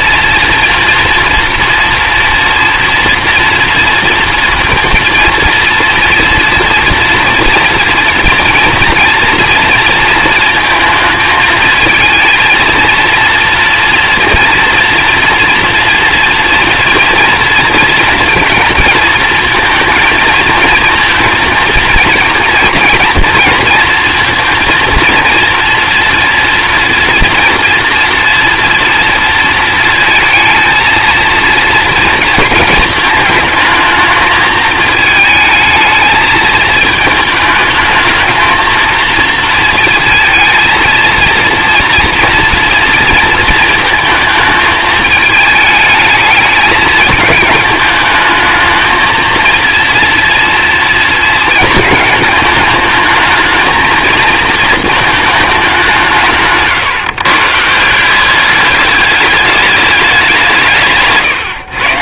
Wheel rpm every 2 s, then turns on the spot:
230, 230, 230, 240, 230, 220, 230, 230, 230, 230, 230, 230, 230, 230, 230, 230, 220, 220, 210, 230, 230, 230, 220, 220, 230, 220, 220, 190, 150, 210, 140.
none